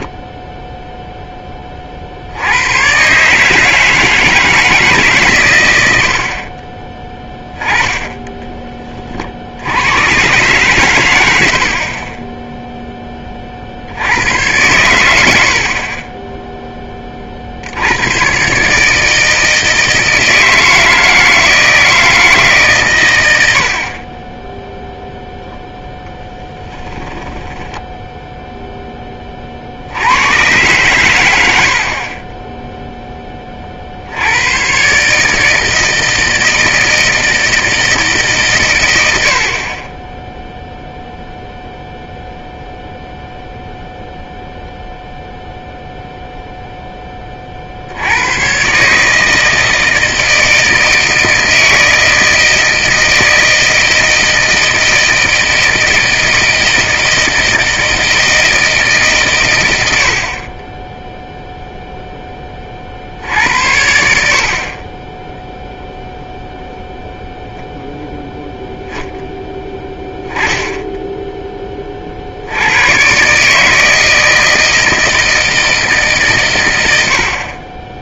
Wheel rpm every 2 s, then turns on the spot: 0, 110, 160, 30, 30, 110, 0, 110, 10, 150, 160, 130, 0, 10, 10, 120, 10, 120, 160, 110, 0, 0, 0, 0, 130, 160, 160, 160, 160, 150, 10, 40, 30, 0, 0, 10, 100, 160, 100.
26-28